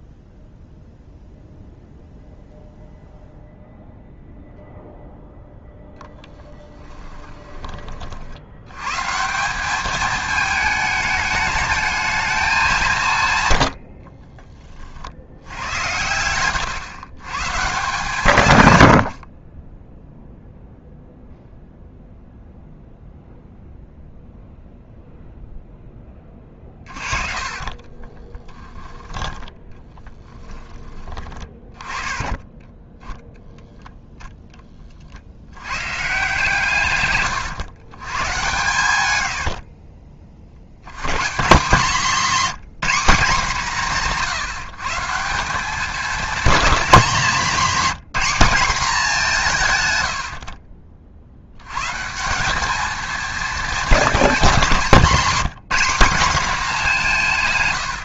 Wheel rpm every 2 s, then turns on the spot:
0, 0, 0, 30, 120, 210, 180, 40, 120, 90, 0, 0, 0, 30, 10, 20, 10, 30, 130, 100, 110, 210, 160, 210, 210, 40, 210, 200, 210.
6-8 26-28 32-34 38-40